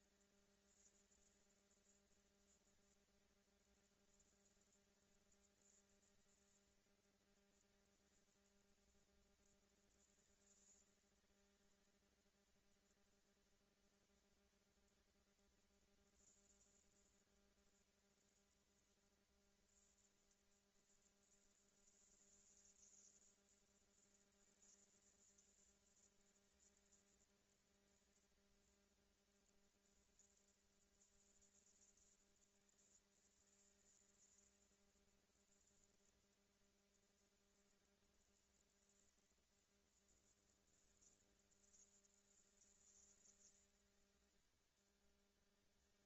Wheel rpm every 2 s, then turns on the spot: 220, 230, 230, 220, 230, 220, 230, 230, 230, 230, 230, 230, 230, 220, 230, 230, 230, 230, 230, 230, 210, 190, 200.
none